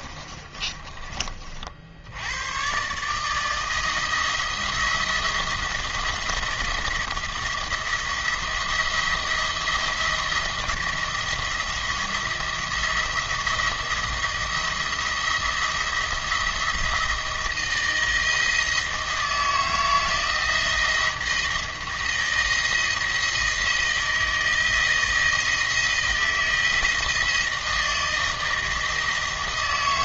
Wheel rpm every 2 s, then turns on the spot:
30, 130, 170, 170, 170, 170, 170, 170, 170, 160, 160, 170, 160, 170, 160.
0-2